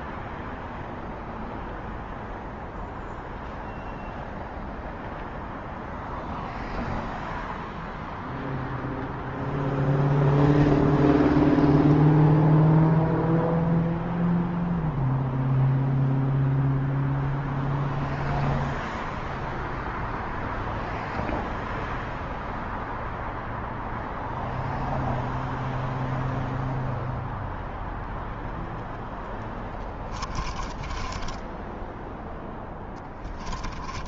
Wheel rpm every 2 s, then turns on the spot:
0, 0, 0, 0, 0, 0, 0, 0, 0, 0, 0, 0, 0, 0, 0, 20, 20.
30-34